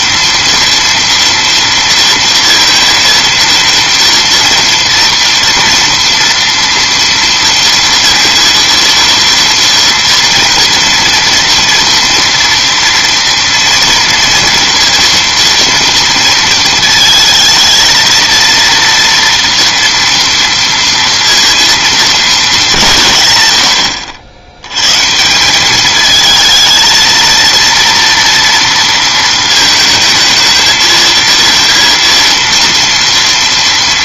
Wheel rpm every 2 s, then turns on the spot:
230, 230, 230, 230, 230, 230, 230, 230, 230, 230, 230, 180, 100, 220, 230, 220, 230.
none